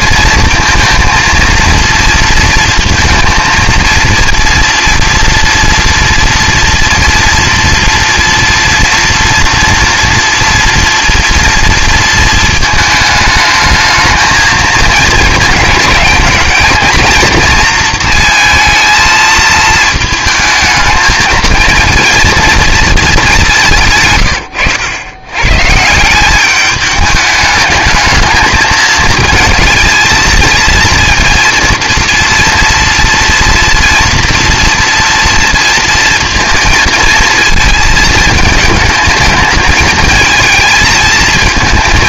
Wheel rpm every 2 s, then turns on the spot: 230, 230, 230, 230, 230, 230, 220, 230, 220, 230, 220, 230, 100, 210, 220, 230, 240, 230, 230, 220, 220.
none